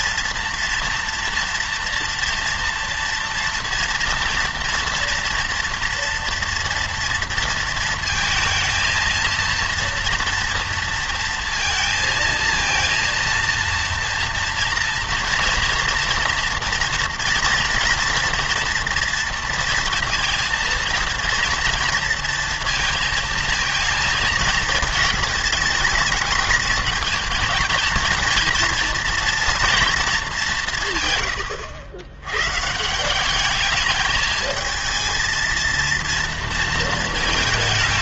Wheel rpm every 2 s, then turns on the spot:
230, 230, 230, 230, 220, 230, 230, 230, 240, 230, 230, 230, 220, 220, 230, 170, 160, 220, 230.
none